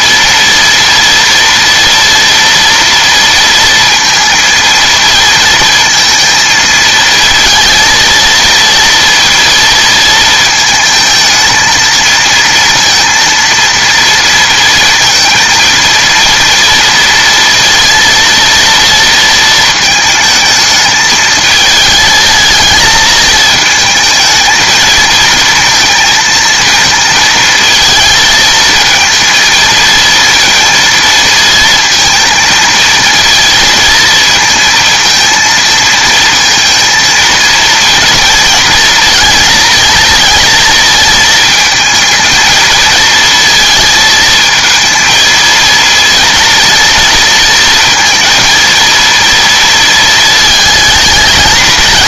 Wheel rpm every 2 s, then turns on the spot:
230, 230, 230, 230, 230, 220, 230, 230, 230, 230, 220, 220, 220, 220, 220, 230, 230, 230, 220, 230, 230, 220, 230, 230, 230, 220.
none